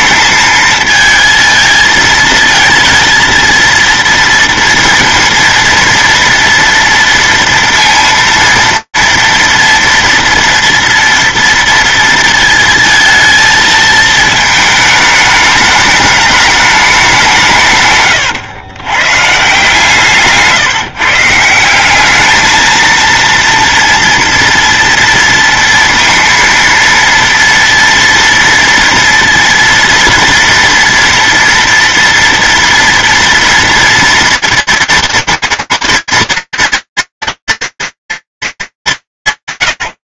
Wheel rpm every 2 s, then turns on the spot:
220, 220, 230, 230, 230, 230, 230, 220, 210, 130, 150, 200, 230, 230, 230, 230, 230, 230, 230, 210.
18-20